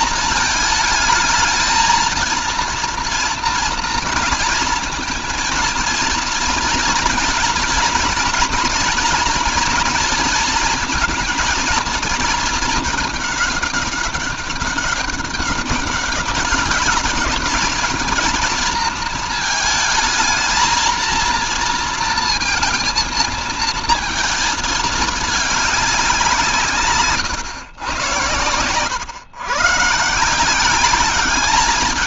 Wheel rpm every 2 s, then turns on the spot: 220, 230, 230, 240, 230, 230, 220, 200, 200, 230, 220, 230, 220, 160, 110, 180.
none